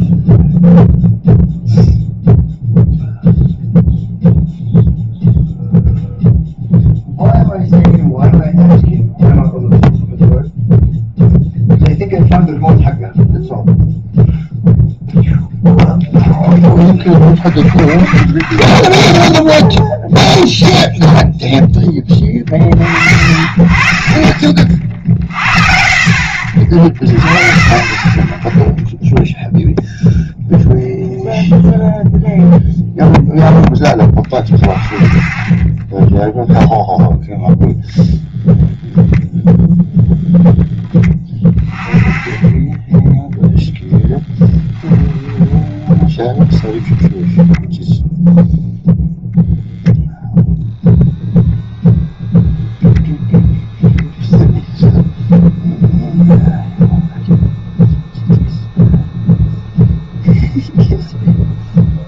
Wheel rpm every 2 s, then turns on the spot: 0, 0, 0, 0, 0, 0, 0, 0, 10, 20, 0, 50, 50, 40, 0, 0, 0, 30, 0, 0, 10, 10, 20, 0, 0, 0, 0, 0, 0, 0, 0.
18-20 44-46